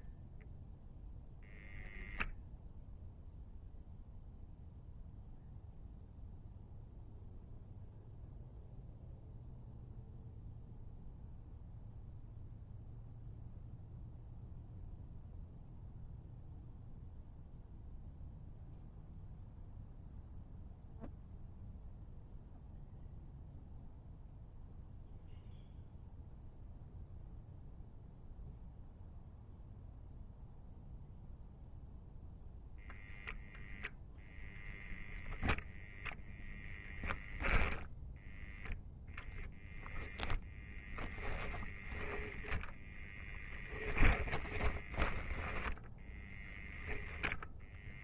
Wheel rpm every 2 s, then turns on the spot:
0, 0, 0, 0, 0, 0, 0, 0, 0, 0, 0, 0, 0, 0, 0, 0, 0, 0, 0, 0, 10, 0, 20, 0.
40-42 44-46